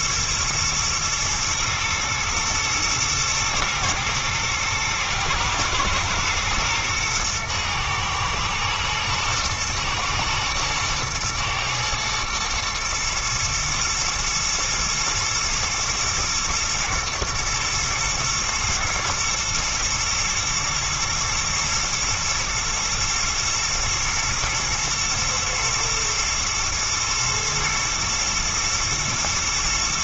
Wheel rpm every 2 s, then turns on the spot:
120, 110, 110, 120, 110, 110, 110, 110, 120, 110, 120, 110, 110, 110, 110.
none